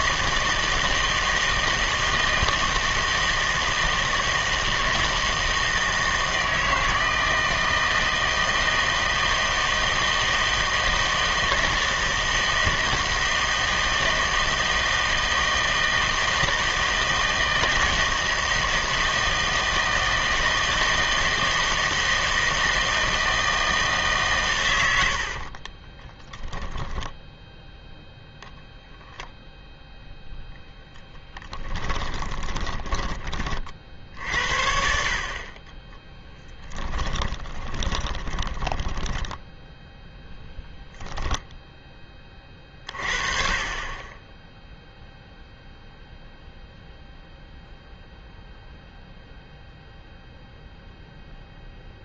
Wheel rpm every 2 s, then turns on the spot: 160, 160, 160, 160, 160, 160, 160, 160, 160, 160, 160, 160, 100, 0, 0, 0, 20, 60, 10, 10, 10, 30, 0, 0, 0, 0.
32-34 36-40